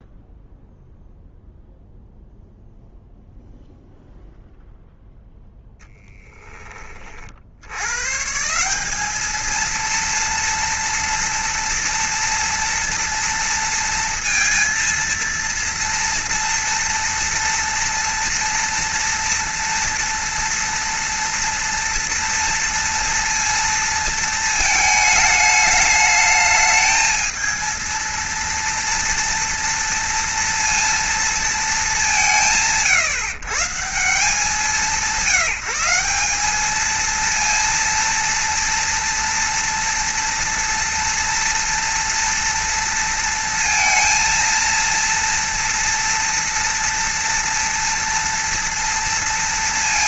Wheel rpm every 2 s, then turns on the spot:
0, 0, 0, 30, 190, 240, 230, 230, 230, 230, 230, 230, 220, 220, 240, 230, 130, 170, 220, 230, 230, 230, 230, 230, 230.
none